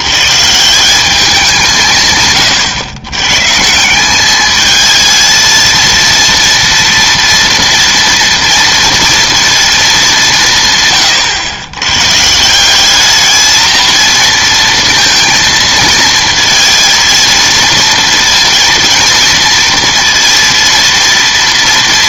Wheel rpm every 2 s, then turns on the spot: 160, 120, 210, 230, 230, 160, 170, 230, 230, 230, 230.
none